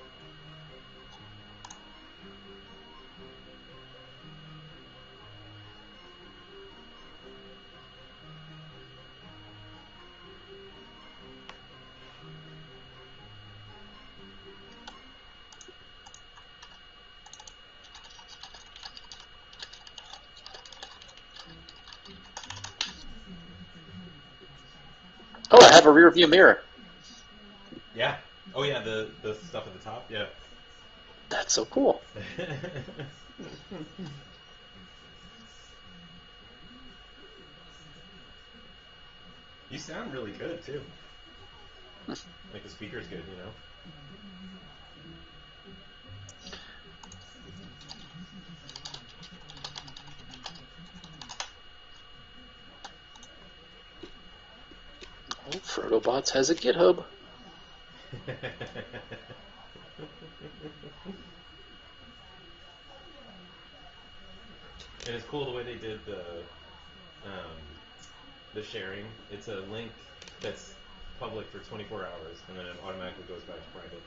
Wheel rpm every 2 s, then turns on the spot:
0, 0, 0, 0, 0, 0, 0, 0, 0, 0, 0, 0, 0, 0, 0, 0, 0, 0, 0, 0, 0, 0, 0, 0, 0, 0, 0, 0, 0, 0, 0, 0, 0, 0, 0, 0, 0.
none